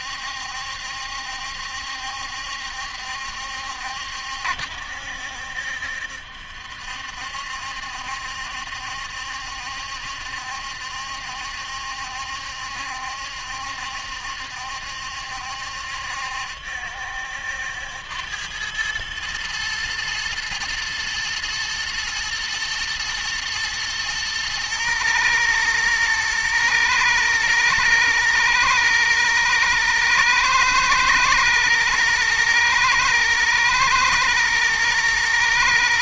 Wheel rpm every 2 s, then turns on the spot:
70, 70, 70, 70, 70, 70, 70, 70, 70, 100, 120, 110, 110, 120, 120, 110, 110, 120.
none